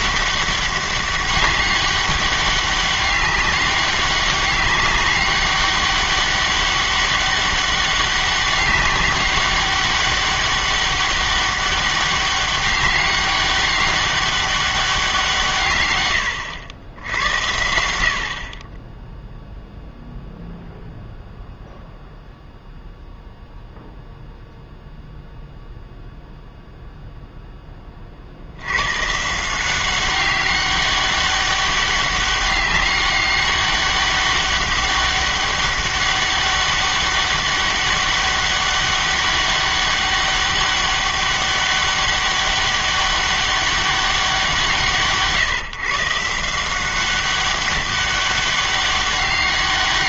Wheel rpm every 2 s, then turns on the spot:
200, 200, 200, 200, 190, 200, 200, 200, 90, 30, 0, 0, 0, 0, 90, 200, 200, 200, 200, 200, 200, 200, 170, 180, 200.
none